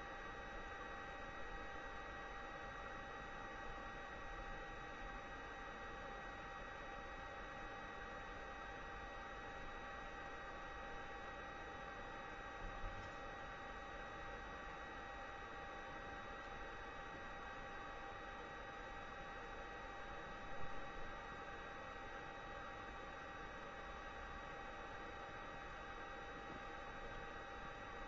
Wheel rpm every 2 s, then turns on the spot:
0, 0, 0, 0, 0, 0, 0, 0, 0, 0, 0, 0, 0, 0.
none